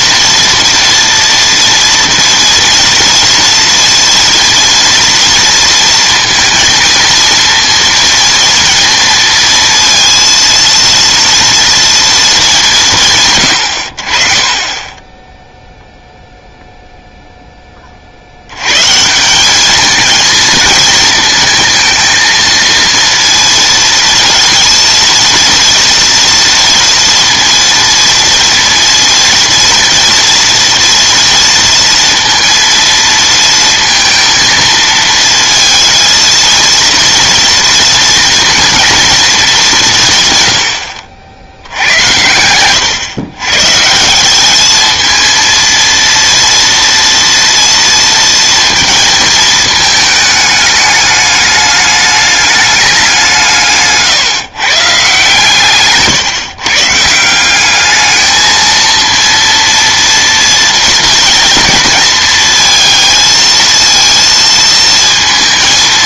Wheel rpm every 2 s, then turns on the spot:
230, 230, 230, 230, 230, 230, 160, 10, 0, 130, 220, 230, 230, 230, 230, 230, 230, 230, 230, 230, 90, 120, 220, 230, 230, 210, 210, 140, 150, 230, 230, 230, 230.
none